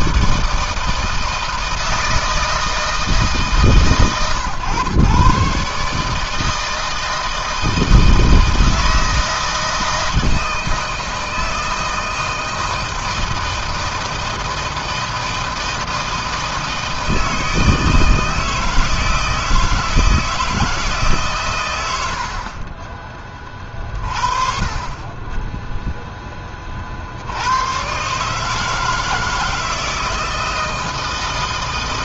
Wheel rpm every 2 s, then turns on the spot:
160, 160, 120, 160, 160, 160, 160, 160, 160, 160, 140, 30, 30, 50, 160, 160.
none